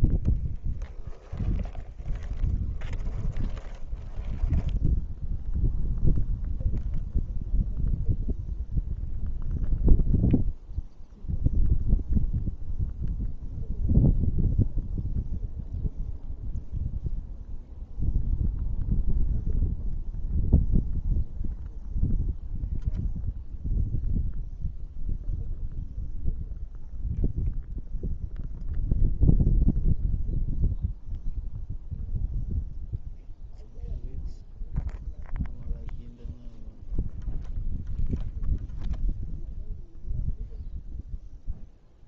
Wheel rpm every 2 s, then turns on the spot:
0, 0, 0, 0, 0, 0, 0, 0, 0, 0, 0, 0, 0, 0, 0, 0, 0, 0, 0, 0, 0.
none